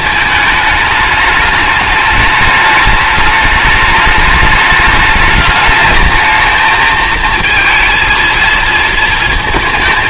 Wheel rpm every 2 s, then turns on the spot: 210, 210, 210, 220, 230.
none